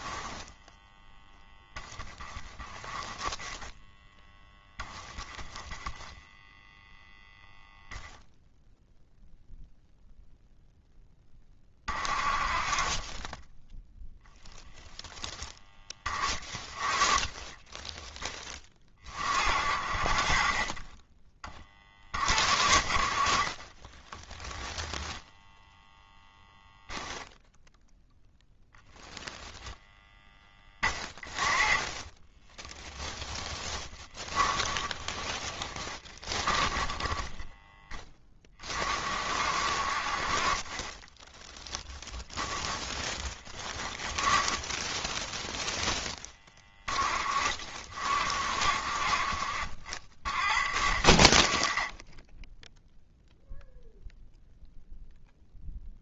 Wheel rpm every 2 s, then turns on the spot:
10, 10, 10, 0, 0, 0, 40, 0, 20, 20, 40, 50, 10, 0, 0, 10, 10, 10, 10, 40, 30, 10, 20, 20, 50, 50, 10, 0.
0-2 30-32 34-38 40-46